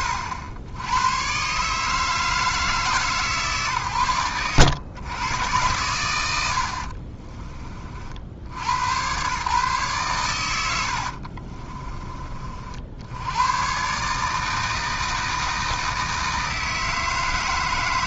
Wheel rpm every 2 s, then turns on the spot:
80, 160, 110, 60, 100, 80, 60, 160, 160.
10-12